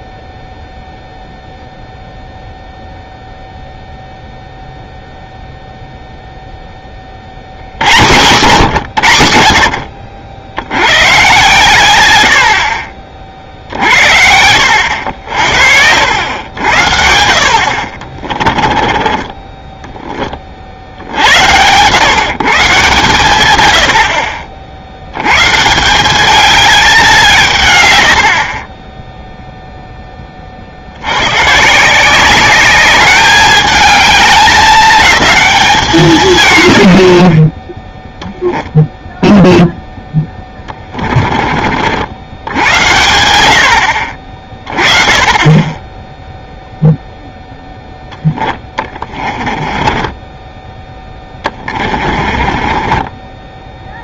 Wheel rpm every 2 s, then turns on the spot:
0, 0, 0, 10, 110, 70, 60, 80, 80, 20, 60, 150, 70, 200, 30, 60, 200, 210, 90, 0, 20, 80, 20, 0, 20, 10, 20.
18-20 40-42 48-54